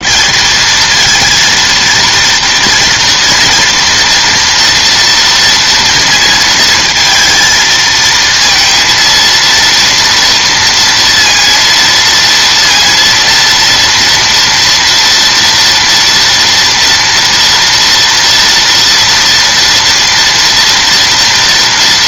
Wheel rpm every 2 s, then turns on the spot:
220, 230, 230, 220, 230, 230, 230, 230, 230, 230, 230.
none